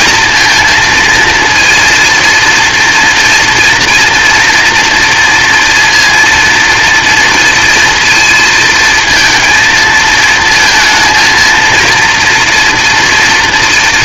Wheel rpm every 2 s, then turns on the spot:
230, 230, 230, 230, 220, 230, 240.
none